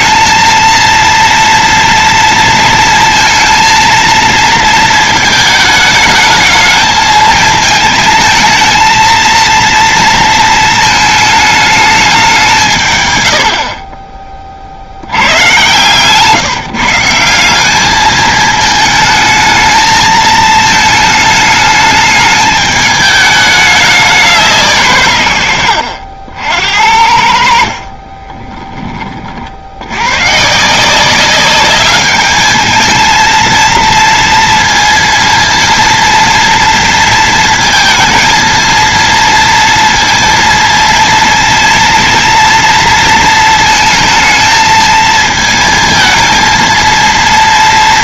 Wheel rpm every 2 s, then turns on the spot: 230, 230, 230, 220, 230, 230, 180, 30, 160, 220, 220, 210, 170, 70, 20, 150, 220, 230, 230, 230, 230, 230, 220, 220.
28-30